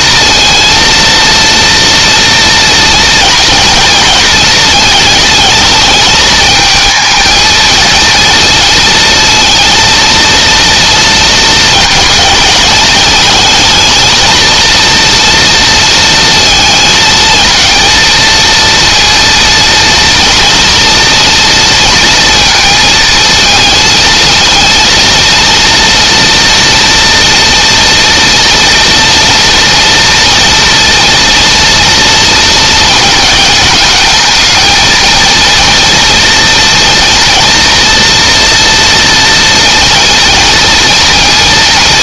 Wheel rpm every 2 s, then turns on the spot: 230, 230, 220, 220, 230, 230, 210, 230, 220, 230, 230, 230, 230, 230, 230, 230, 220, 220, 230, 230, 230.
none